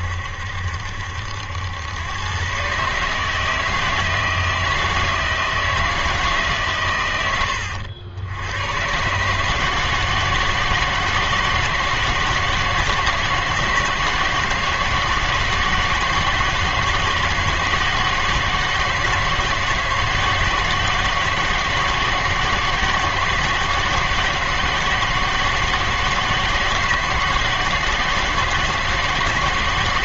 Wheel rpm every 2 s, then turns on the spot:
70, 140, 160, 140, 110, 160, 160, 160, 160, 160, 160, 160, 160, 160, 160.
none